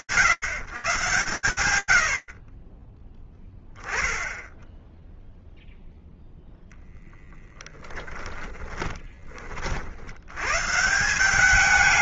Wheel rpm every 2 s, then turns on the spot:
150, 40, 0, 0, 20, 170.
8-10